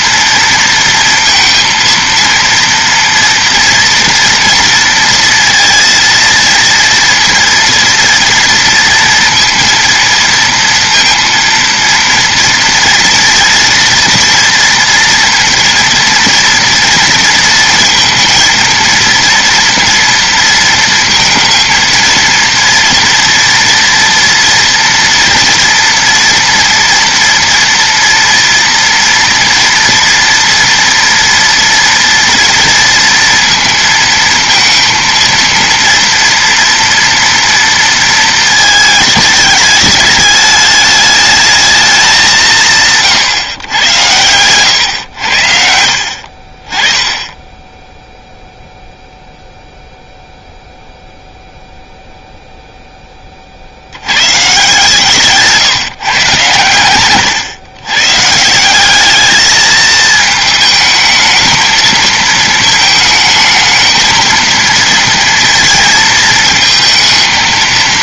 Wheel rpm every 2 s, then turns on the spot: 230, 230, 230, 230, 230, 230, 240, 230, 230, 230, 230, 230, 230, 230, 230, 230, 230, 230, 230, 220, 210, 160, 100, 30, 0, 0, 0, 150, 120, 180, 220, 220, 230, 220.
none